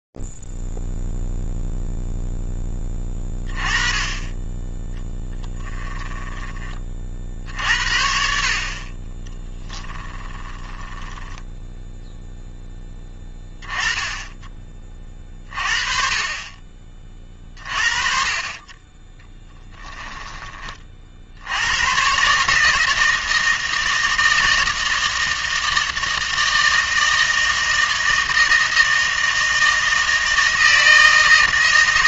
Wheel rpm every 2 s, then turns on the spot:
0, 0, 20, 10, 60, 20, 0, 20, 40, 30, 20, 140, 160, 160, 160, 160.
6-8 10-12